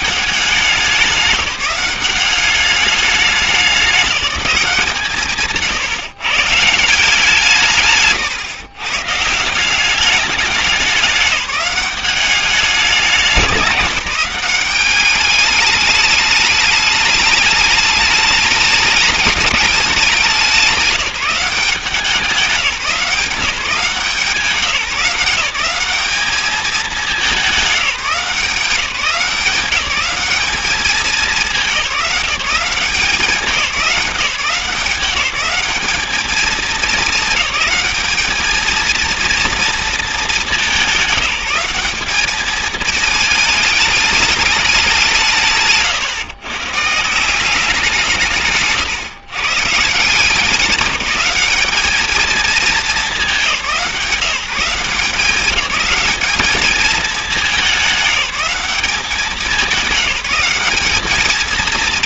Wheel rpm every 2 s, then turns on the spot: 190, 200, 180, 160, 120, 200, 200, 200, 210, 210, 190, 170, 180, 210, 180, 200, 170, 180, 210, 220, 200, 220, 200, 130, 150, 190, 220, 180, 210, 200, 200.
none